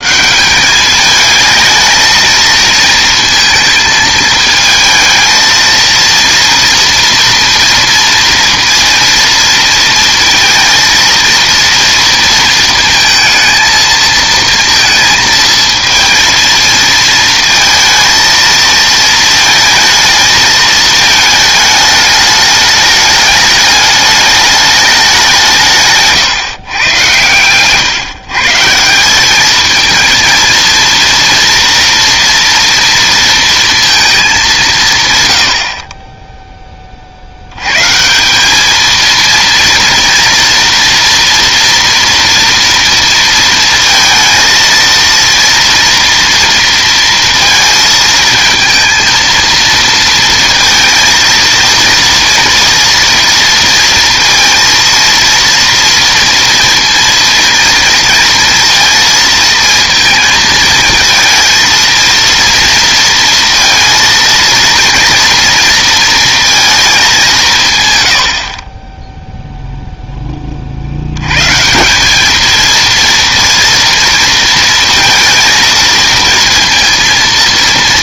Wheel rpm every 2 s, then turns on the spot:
200, 220, 220, 230, 230, 230, 230, 230, 230, 220, 220, 210, 210, 130, 150, 230, 230, 180, 10, 200, 230, 230, 230, 230, 220, 230, 230, 230, 230, 230, 220, 230, 230, 220, 40, 40, 230, 230, 230.
none